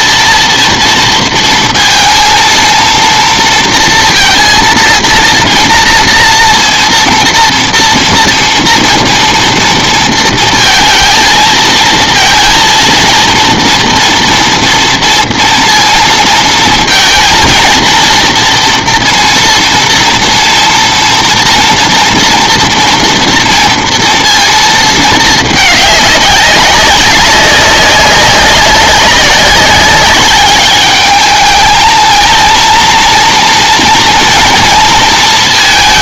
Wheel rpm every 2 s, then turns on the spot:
230, 230, 230, 240, 230, 230, 230, 230, 230, 230, 230, 230, 220, 190, 190, 210, 230, 230.
none